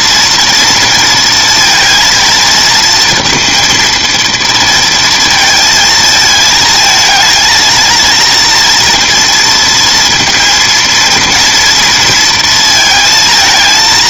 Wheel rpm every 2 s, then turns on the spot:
230, 230, 230, 220, 240, 230, 230.
none